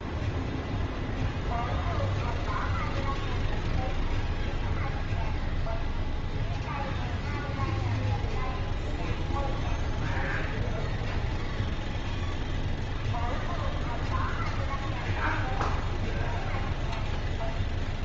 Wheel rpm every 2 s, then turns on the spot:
0, 0, 0, 0, 0, 0, 0, 0, 0.
none